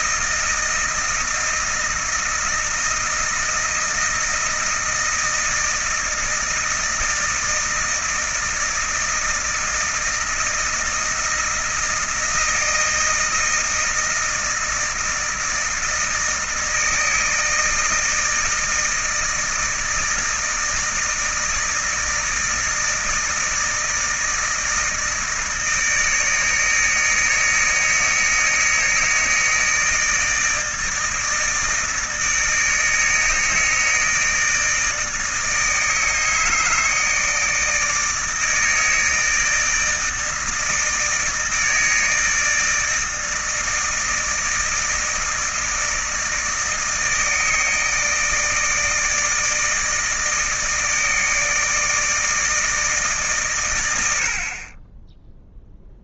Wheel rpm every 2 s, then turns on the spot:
160, 160, 160, 160, 160, 160, 160, 160, 160, 160, 160, 160, 160, 160, 160, 160, 150, 160, 160, 160, 160, 150, 150, 160, 160, 160, 160, 80.
none